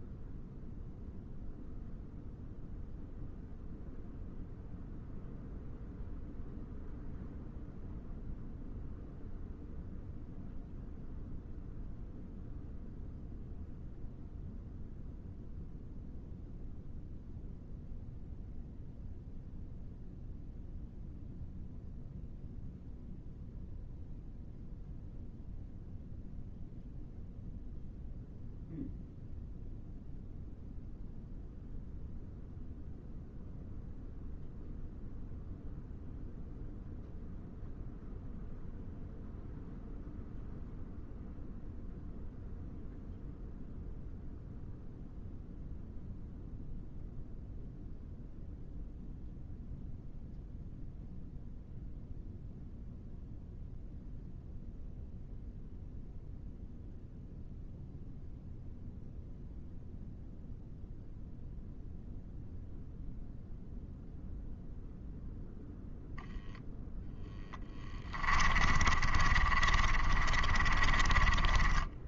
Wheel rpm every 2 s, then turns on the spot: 0, 0, 0, 0, 0, 0, 0, 0, 0, 0, 0, 0, 0, 0, 0, 0, 0, 0, 0, 0, 0, 0, 0, 0, 0, 0, 0, 0, 0, 0, 0, 0, 0, 0, 30, 30.
68-72